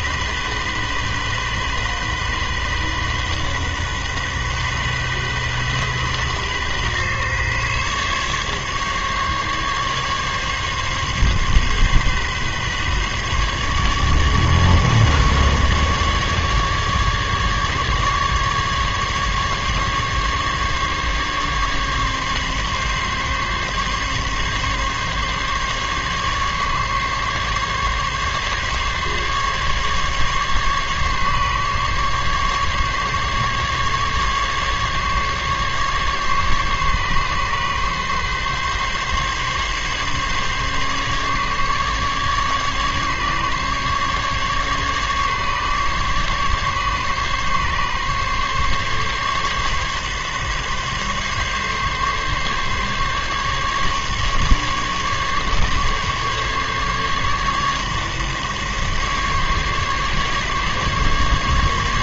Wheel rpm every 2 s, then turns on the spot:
130, 130, 130, 130, 140, 140, 140, 150, 150, 150, 140, 140, 140, 140, 140, 140, 140, 140, 140, 140, 140, 140, 140, 140, 140, 140, 140, 140, 140, 140, 140.
none